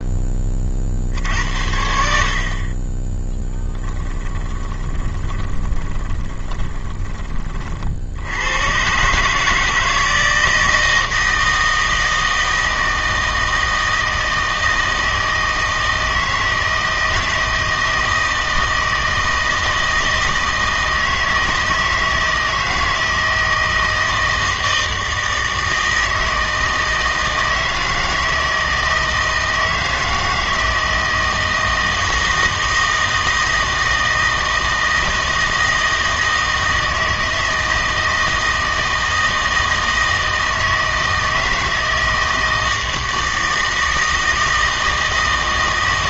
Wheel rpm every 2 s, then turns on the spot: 40, 40, 20, 20, 100, 160, 160, 160, 160, 160, 160, 160, 160, 160, 160, 160, 160, 160, 160, 160, 160, 160, 160.
4-8